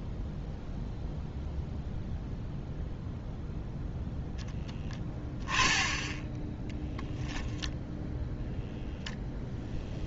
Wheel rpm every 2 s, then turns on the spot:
0, 0, 10, 10, 0.
none